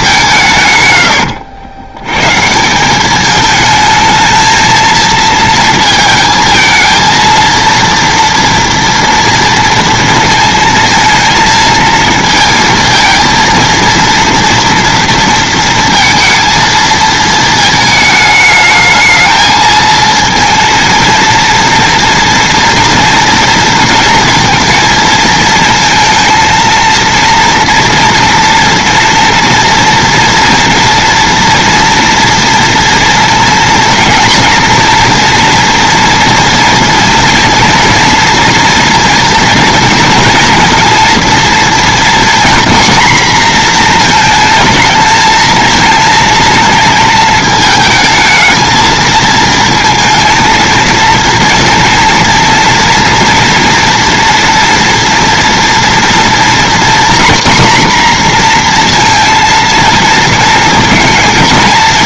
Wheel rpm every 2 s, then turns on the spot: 150, 150, 220, 220, 230, 230, 230, 230, 230, 210, 230, 230, 220, 230, 230, 230, 230, 230, 240, 240, 230, 240, 220, 230, 220, 220, 230, 240, 240, 240, 230.
none